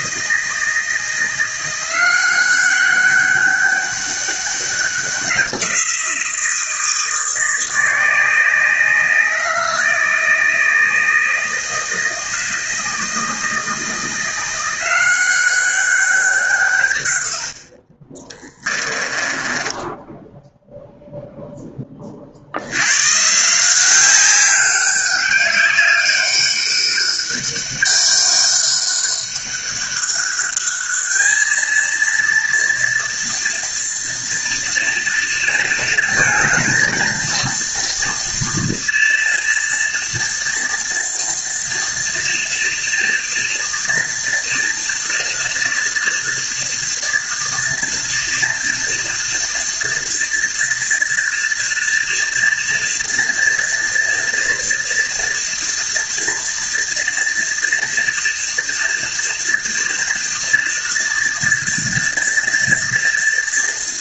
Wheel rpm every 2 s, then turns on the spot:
160, 190, 190, 160, 160, 160, 160, 180, 130, 20, 0, 110, 200, 200, 200, 210, 230, 230, 230, 230, 230, 230, 230, 230, 230, 240, 240, 230, 230, 230, 230, 230.
18-20